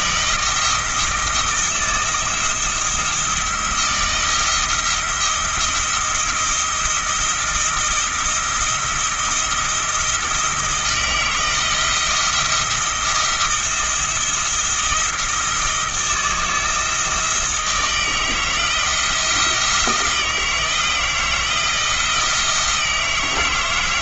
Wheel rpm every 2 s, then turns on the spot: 160, 170, 170, 170, 170, 160, 170, 160, 160, 160, 160, 160.
none